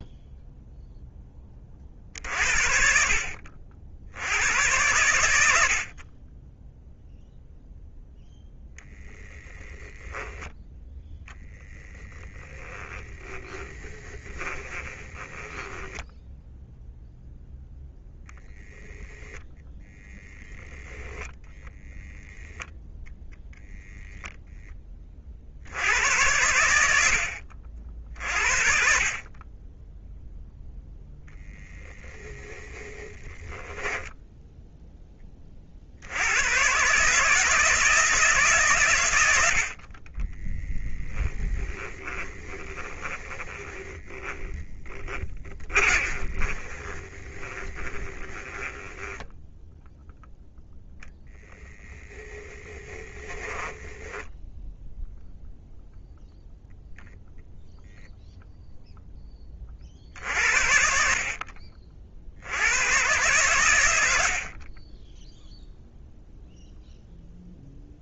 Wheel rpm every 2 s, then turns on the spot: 0, 60, 100, 0, 0, 10, 20, 20, 0, 0, 0, 0, 20, 80, 40, 0, 10, 0, 150, 110, 20, 20, 20, 20, 10, 0, 20, 0, 0, 0, 60, 110, 10, 0.
12-16 32-34 40-50 52-54